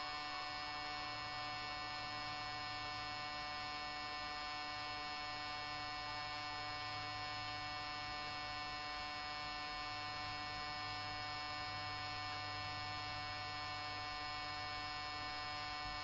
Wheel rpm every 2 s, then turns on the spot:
0, 0, 0, 0, 0, 0, 0, 0.
none